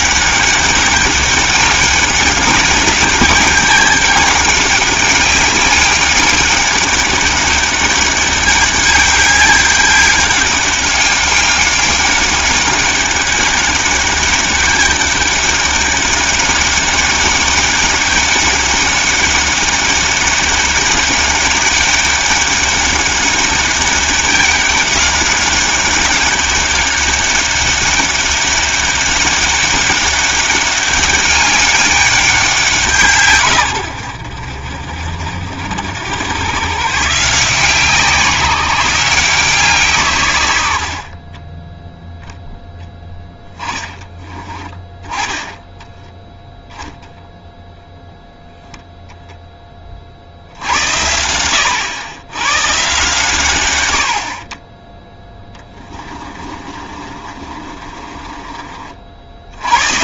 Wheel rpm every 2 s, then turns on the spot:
200, 200, 200, 200, 200, 200, 190, 200, 200, 200, 200, 200, 200, 200, 200, 200, 180, 50, 120, 180, 80, 0, 20, 0, 10, 70, 110, 30, 30, 40.
56-58